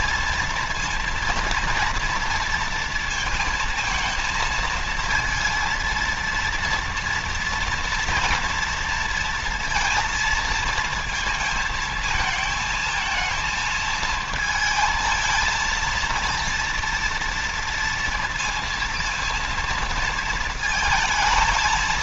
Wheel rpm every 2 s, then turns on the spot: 230, 230, 230, 230, 230, 230, 220, 230, 240, 230, 220.
none